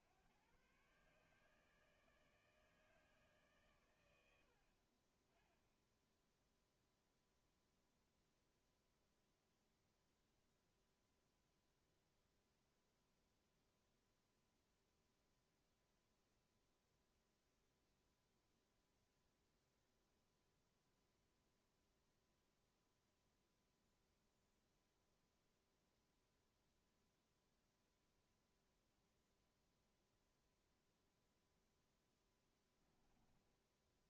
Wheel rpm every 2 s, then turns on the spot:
90, 150, 80, 0, 0, 0, 0, 0, 0, 0, 0, 0, 0, 0, 0, 0, 10.
32-34